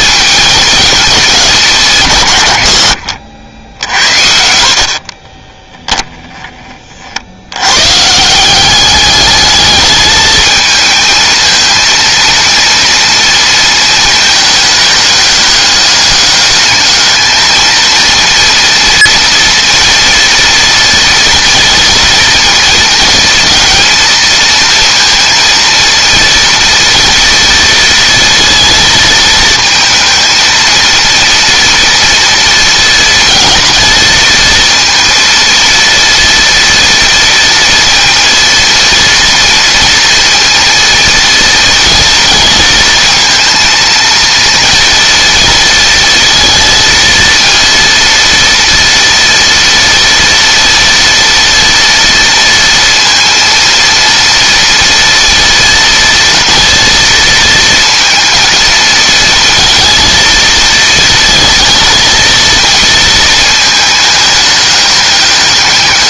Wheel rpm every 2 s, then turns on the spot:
220, 80, 50, 40, 200, 220, 230, 210, 210, 230, 230, 230, 230, 230, 230, 230, 230, 230, 230, 230, 230, 230, 230, 230, 230, 230, 230, 230, 220, 230, 230, 230, 210.
4-6